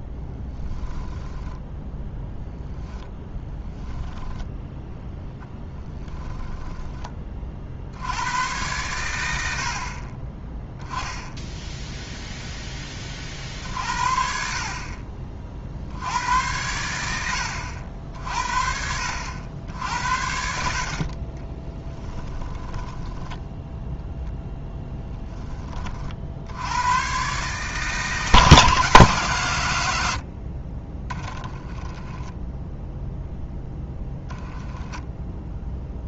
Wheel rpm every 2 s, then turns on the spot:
10, 0, 0, 10, 100, 10, 10, 40, 90, 60, 50, 10, 0, 100, 150, 30, 0, 10.
22-24 34-36